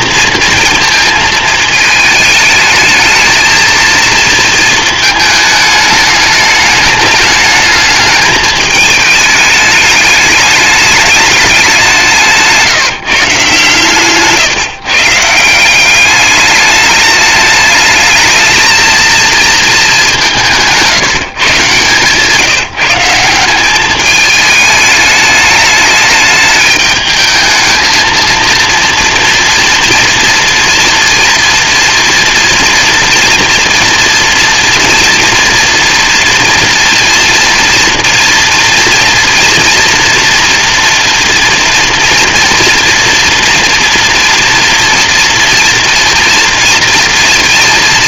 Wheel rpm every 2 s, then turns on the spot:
220, 220, 220, 210, 210, 210, 170, 160, 210, 220, 160, 160, 210, 210, 230, 230, 230, 230, 230, 240, 230, 230, 230, 230.
20-22